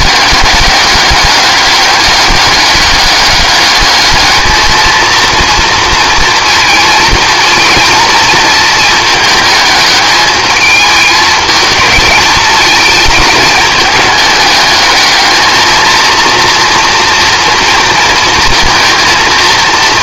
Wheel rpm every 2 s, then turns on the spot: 200, 200, 220, 230, 220, 210, 220, 210, 230, 230.
none